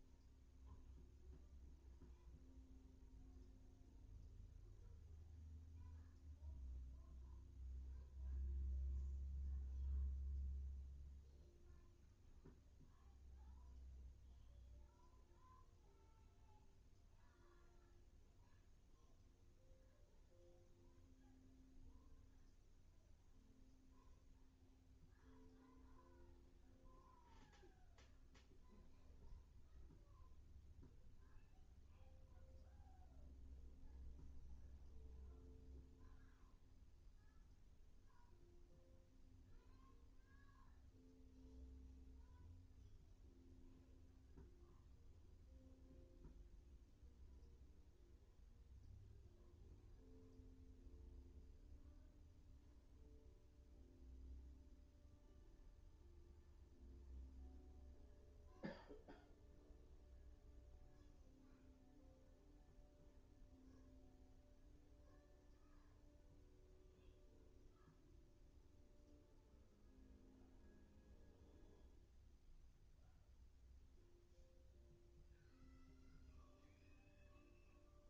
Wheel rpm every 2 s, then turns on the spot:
0, 0, 0, 0, 0, 0, 0, 0, 0, 0, 0, 0, 0, 0, 0, 0, 0, 0, 0, 0, 0, 0, 0, 0, 0, 0, 0, 0, 0, 0, 0, 0, 0, 0, 0, 0, 0, 0, 0.
none